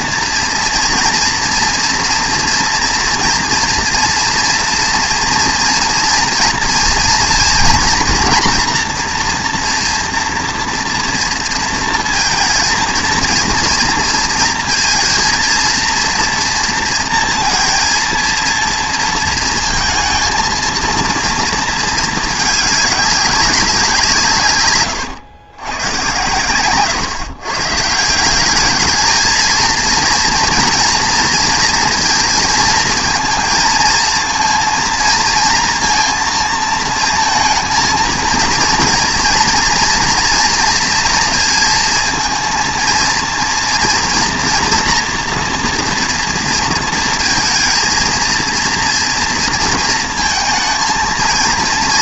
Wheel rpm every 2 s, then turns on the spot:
230, 230, 240, 230, 240, 240, 230, 230, 230, 230, 230, 210, 120, 120, 200, 230, 230, 230, 220, 230, 230, 230, 240, 230, 230, 220.
none